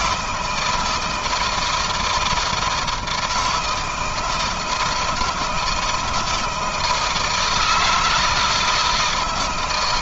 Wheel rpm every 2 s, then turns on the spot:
170, 160, 160, 160, 160.
none